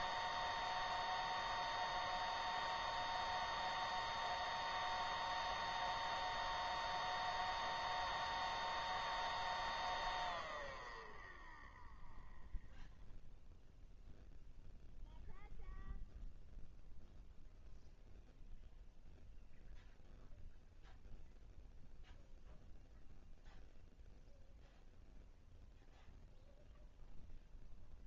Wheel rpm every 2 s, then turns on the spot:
0, 0, 0, 0, 0, 0, 0, 0, 0, 0, 0, 0, 0, 0.
none